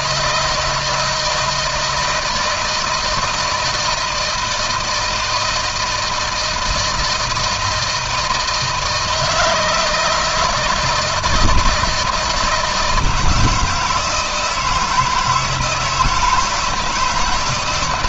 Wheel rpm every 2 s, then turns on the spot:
170, 160, 160, 170, 160, 160, 160, 170, 160.
none